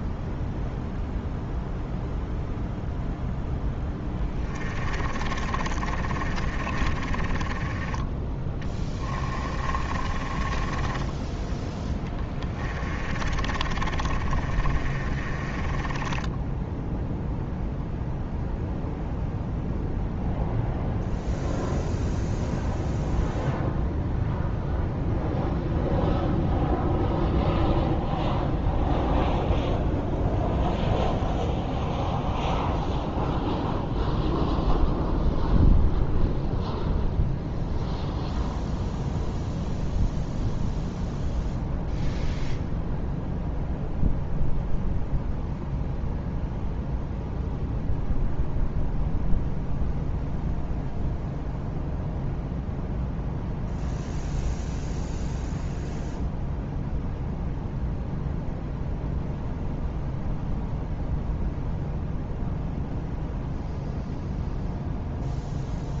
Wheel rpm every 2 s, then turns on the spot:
0, 0, 20, 20, 10, 20, 20, 30, 0, 0, 0, 0, 0, 0, 0, 0, 0, 0, 0, 0, 0, 0, 0, 0, 0, 0, 0, 0, 0, 0, 0, 0, 0.
4-16